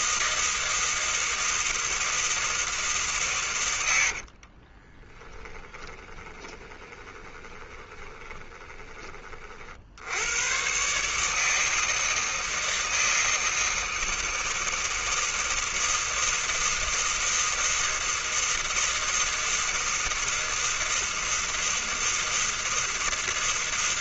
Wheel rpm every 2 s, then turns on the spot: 160, 150, 20, 20, 20, 140, 160, 160, 160, 160, 160, 160.
4-8